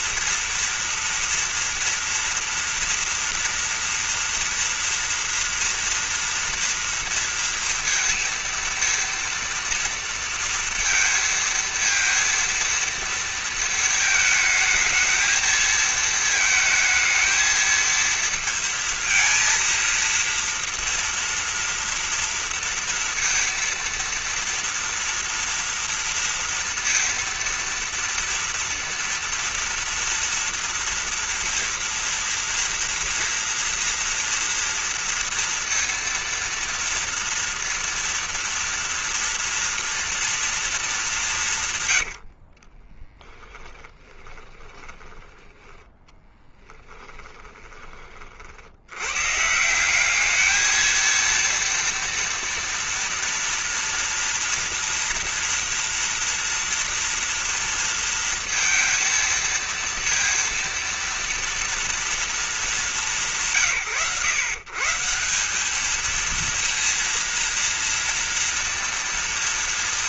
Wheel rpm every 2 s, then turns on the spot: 230, 230, 230, 230, 230, 230, 230, 220, 220, 230, 230, 230, 230, 230, 230, 230, 230, 240, 230, 230, 230, 90, 20, 20, 40, 200, 240, 230, 230, 230, 230, 230, 130, 220, 230.
42-48